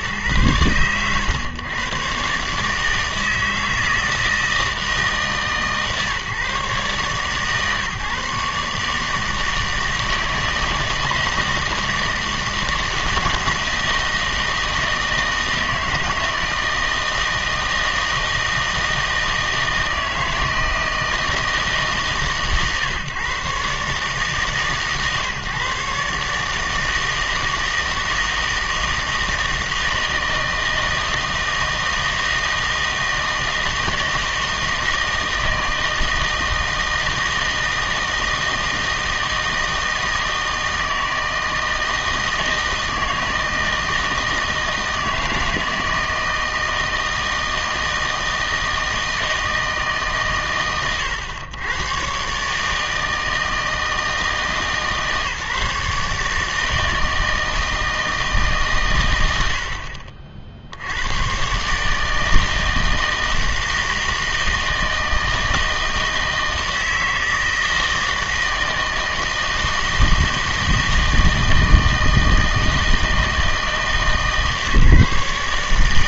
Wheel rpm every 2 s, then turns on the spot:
110, 150, 160, 140, 150, 160, 160, 160, 160, 160, 160, 140, 140, 150, 160, 160, 160, 160, 160, 160, 160, 160, 160, 160, 160, 120, 150, 160, 150, 140, 70, 160, 160, 160, 160, 160, 160, 150.
none